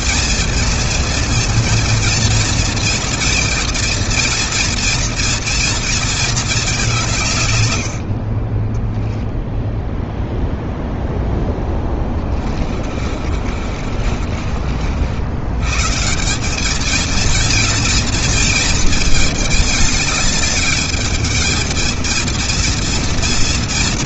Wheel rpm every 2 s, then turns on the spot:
230, 230, 230, 170, 10, 0, 40, 80, 230, 230, 210, 230.
8-10 12-14